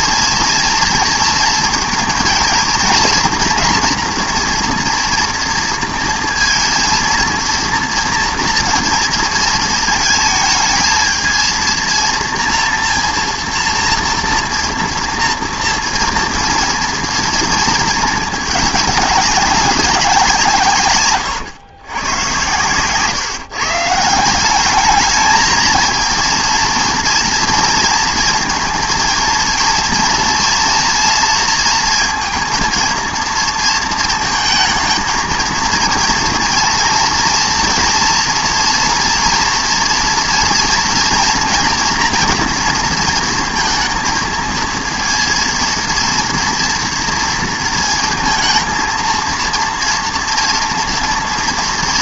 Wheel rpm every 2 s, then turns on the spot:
230, 220, 240, 230, 230, 220, 230, 230, 240, 210, 160, 110, 190, 230, 230, 230, 230, 220, 230, 230, 230, 230, 230, 240, 230, 230.
none